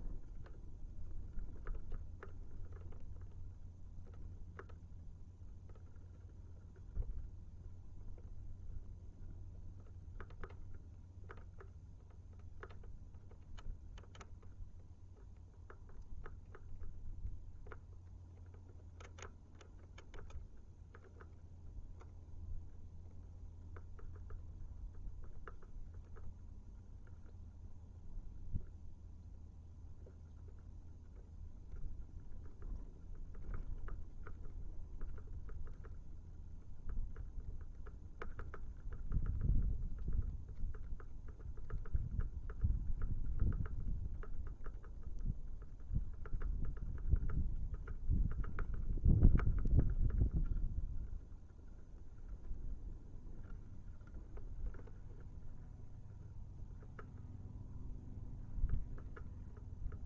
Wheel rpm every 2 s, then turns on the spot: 0, 0, 0, 0, 0, 0, 0, 0, 0, 0, 0, 0, 0, 0, 0, 0, 0, 0, 0, 0, 0, 0, 0, 0, 0, 0, 0, 0, 0, 0.
none